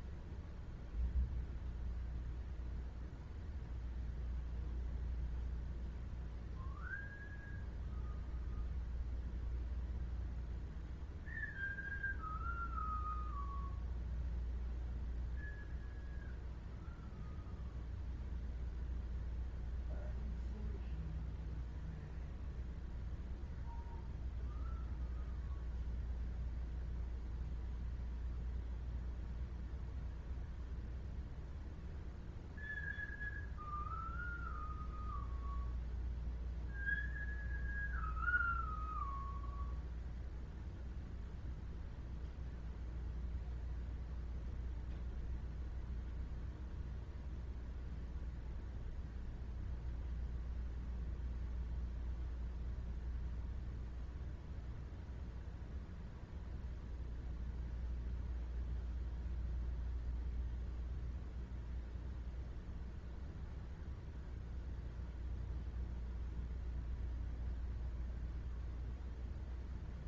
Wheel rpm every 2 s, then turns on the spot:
0, 0, 0, 0, 0, 0, 0, 0, 0, 0, 0, 0, 0, 0, 0, 0, 0, 0, 0, 0, 0, 0, 0, 0, 0, 0, 0, 0, 0, 0, 0, 0, 0, 0, 0.
none